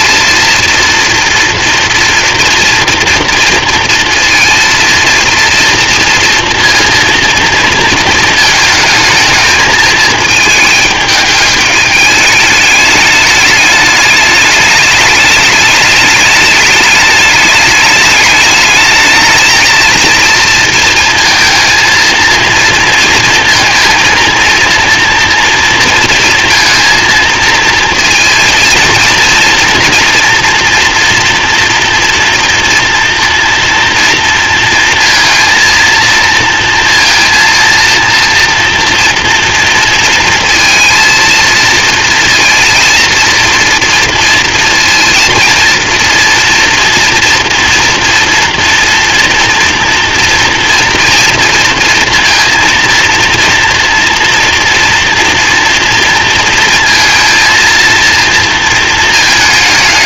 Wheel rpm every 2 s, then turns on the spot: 230, 240, 230, 230, 220, 220, 220, 210, 210, 220, 230, 230, 230, 230, 230, 240, 230, 230, 230, 240, 230, 230, 230, 230, 230, 230, 230, 230, 230, 230.
none